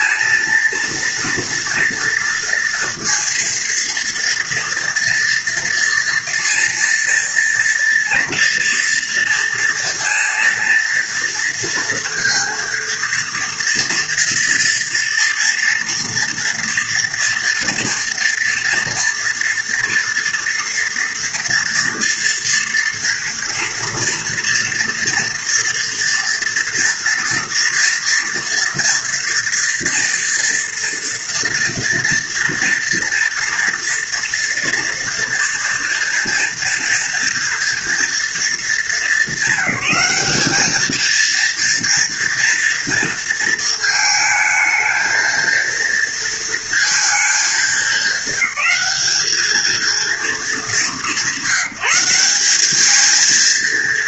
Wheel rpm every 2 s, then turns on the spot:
230, 230, 230, 230, 230, 230, 230, 230, 230, 230, 230, 230, 240, 240, 240, 230, 230, 240, 230, 200, 230, 230, 220, 220, 200, 190, 220.
none